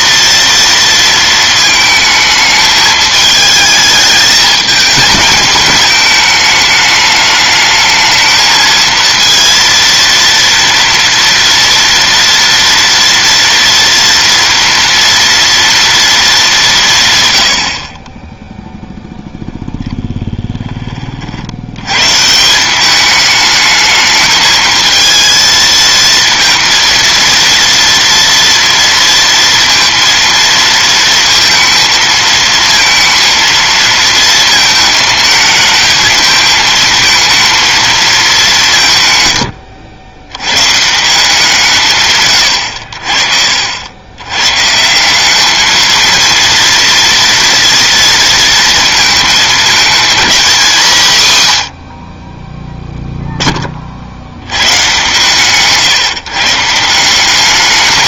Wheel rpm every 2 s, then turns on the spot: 240, 220, 220, 220, 220, 230, 230, 240, 210, 10, 10, 170, 220, 230, 230, 230, 220, 220, 220, 180, 120, 100, 130, 230, 230, 230, 10, 100, 150.
none